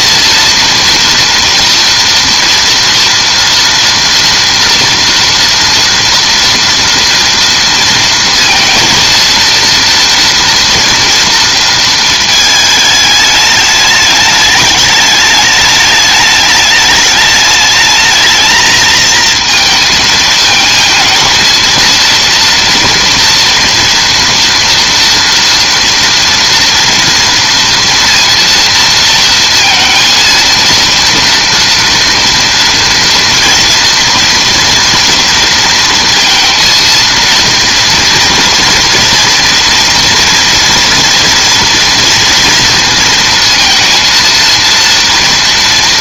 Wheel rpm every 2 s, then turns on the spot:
230, 230, 240, 230, 230, 230, 220, 210, 210, 220, 220, 230, 230, 230, 230, 230, 240, 230, 230, 230, 240, 230, 230.
none